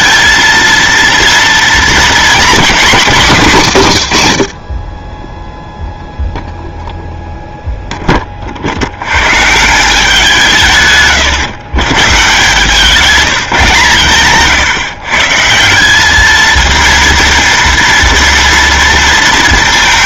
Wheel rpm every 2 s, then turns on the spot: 230, 220, 40, 0, 60, 150, 160, 130, 220, 230.
none